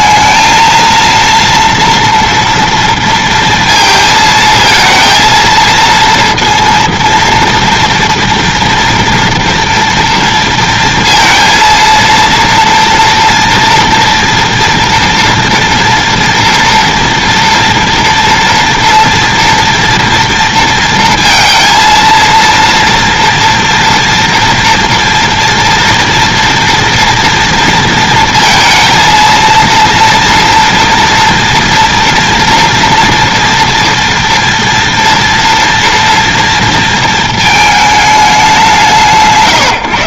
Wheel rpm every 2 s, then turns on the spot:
230, 230, 230, 230, 230, 230, 230, 230, 230, 230, 230, 230, 230, 230, 230, 230, 230, 230, 230, 170.
none